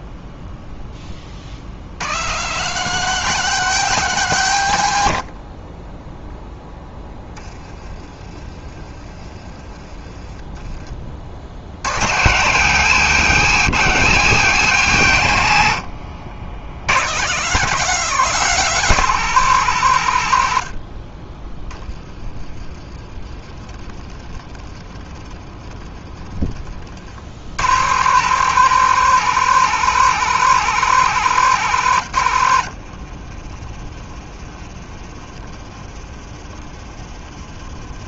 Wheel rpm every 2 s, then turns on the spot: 0, 200, 140, 10, 30, 30, 140, 130, 60, 200, 80, 30, 30, 50, 180, 180, 70, 20, 20.
32-34